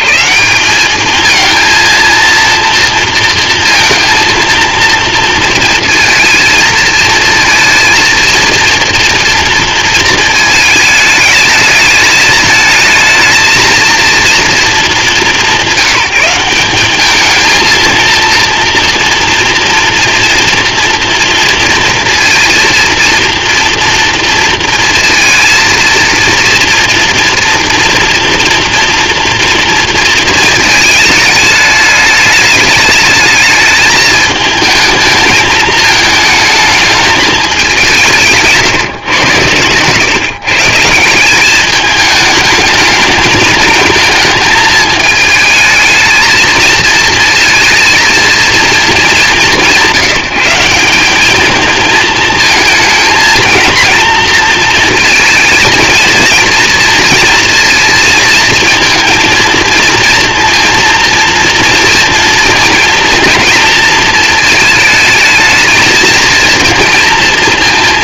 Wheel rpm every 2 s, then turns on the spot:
120, 230, 230, 220, 230, 220, 220, 230, 190, 230, 230, 230, 230, 230, 240, 220, 210, 220, 220, 160, 130, 210, 220, 220, 230, 180, 220, 230, 230, 220, 230, 230, 220, 230.
38-40